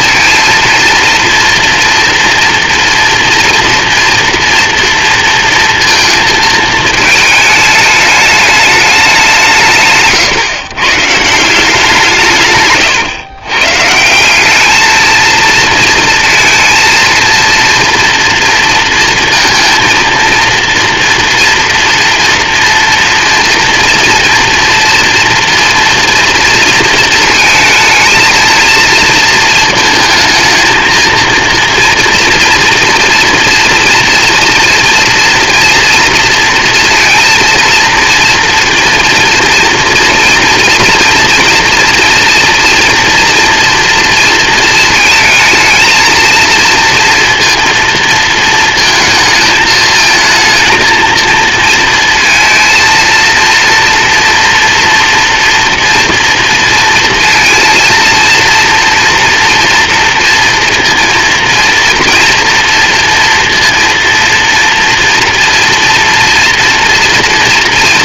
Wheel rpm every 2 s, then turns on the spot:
230, 230, 230, 220, 180, 150, 130, 230, 230, 230, 240, 230, 230, 230, 230, 230, 240, 240, 230, 230, 230, 230, 220, 230, 220, 220, 230, 230, 230, 230, 230, 230, 230, 240.
none